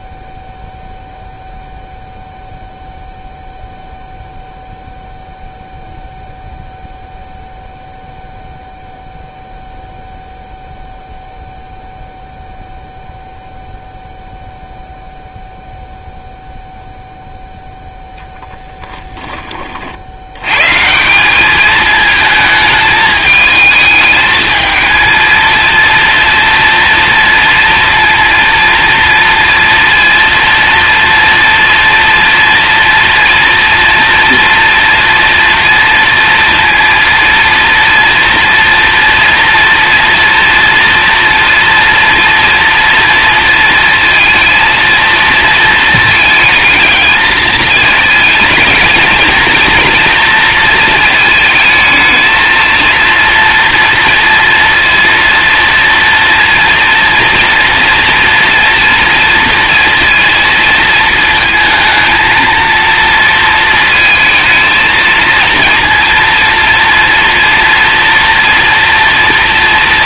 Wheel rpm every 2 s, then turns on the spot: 0, 0, 0, 0, 0, 0, 0, 0, 0, 10, 150, 220, 220, 230, 230, 230, 240, 230, 230, 230, 230, 230, 230, 220, 220, 230, 230, 230, 230, 230, 230, 230, 220, 230, 230.
none